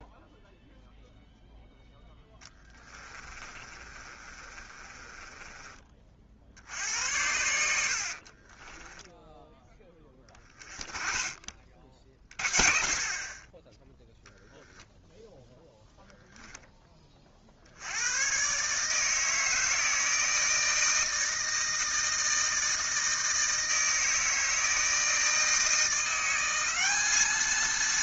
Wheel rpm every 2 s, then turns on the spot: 0, 20, 30, 60, 30, 30, 40, 0, 10, 140, 160, 160, 160, 190.
2-6 8-10